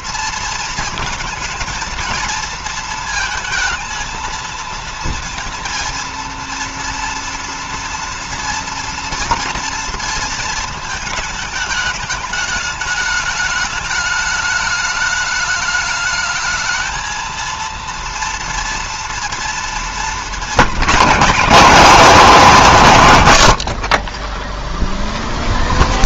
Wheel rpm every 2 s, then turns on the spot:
230, 220, 230, 230, 230, 220, 210, 210, 220, 230, 200, 100, 0.
none